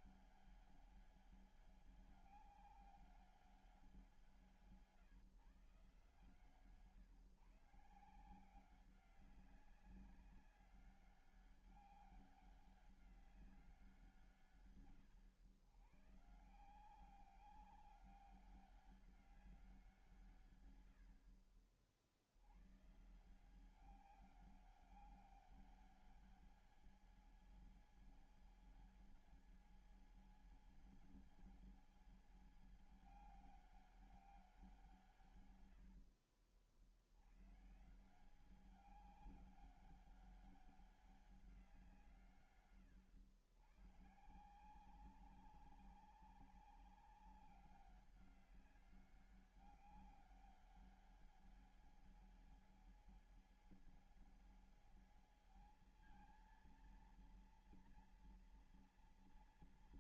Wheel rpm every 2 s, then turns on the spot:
200, 200, 160, 130, 160, 190, 200, 130, 150, 190, 130, 90, 190, 200, 200, 200, 200, 190, 70, 180, 200, 160, 160, 200, 200, 200, 200, 200, 220, 230.
none